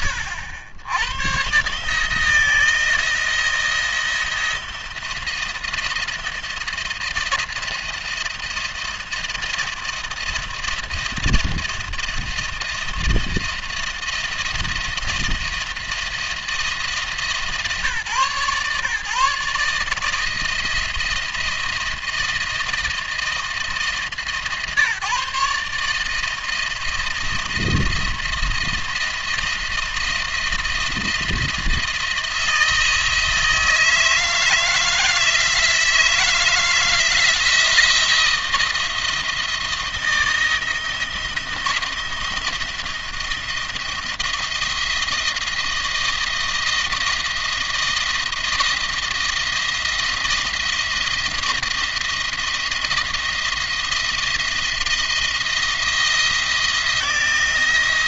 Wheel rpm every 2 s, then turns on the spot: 100, 170, 170, 170, 170, 160, 170, 160, 170, 140, 170, 160, 150, 160, 170, 170, 160, 160, 170, 170, 160, 170, 160, 170, 170, 170, 170, 170, 170.
none